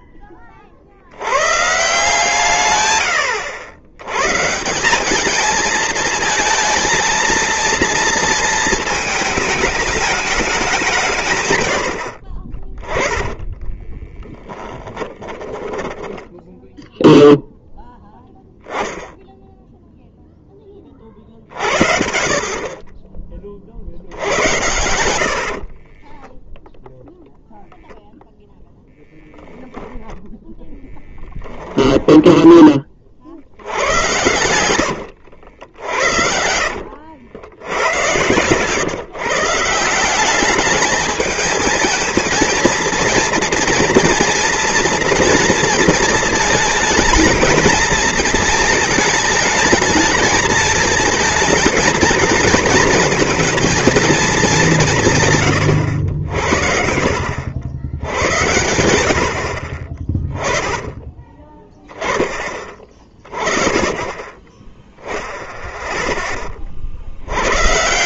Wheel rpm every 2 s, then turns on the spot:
60, 110, 190, 230, 220, 170, 20, 20, 0, 0, 30, 30, 70, 0, 0, 10, 30, 100, 70, 140, 210, 230, 230, 220, 230, 220, 230, 170, 70, 100, 10, 20, 0, 40.
12-16 34-38